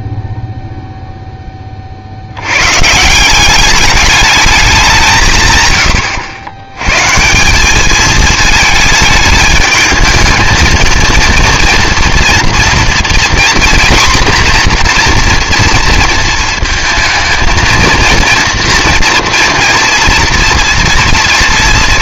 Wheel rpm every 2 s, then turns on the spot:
0, 110, 200, 110, 220, 220, 230, 240, 230, 230, 230.
none